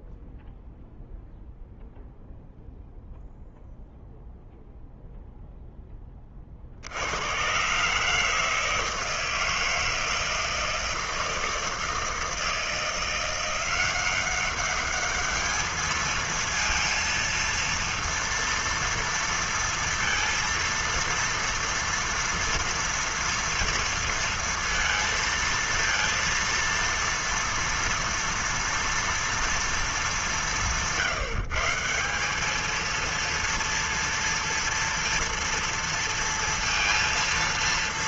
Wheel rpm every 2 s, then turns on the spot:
0, 0, 0, 20, 150, 160, 160, 180, 220, 230, 230, 230, 230, 230, 230, 210, 180, 230, 230.
none